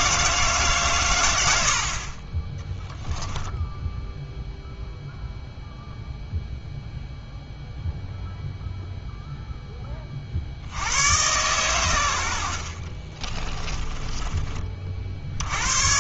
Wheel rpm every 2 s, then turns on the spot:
150, 20, 0, 0, 0, 70, 60, 20.
12-14